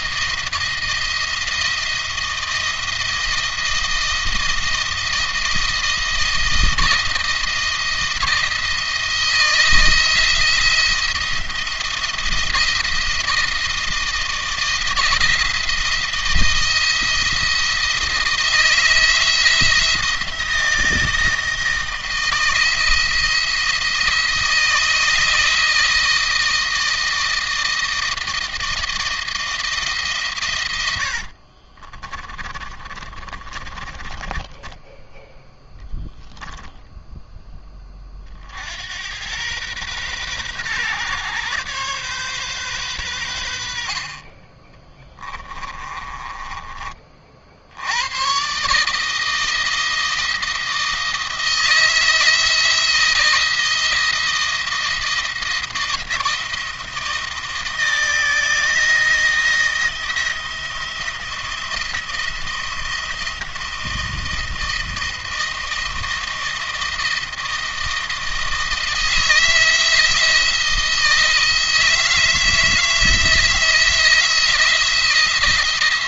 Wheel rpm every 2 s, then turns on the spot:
170, 160, 170, 170, 160, 170, 170, 170, 170, 160, 160, 170, 160, 160, 160, 100, 30, 10, 0, 80, 130, 120, 20, 30, 130, 170, 170, 170, 170, 160, 170, 170, 170, 160, 160, 160, 160, 170.
32-36 44-46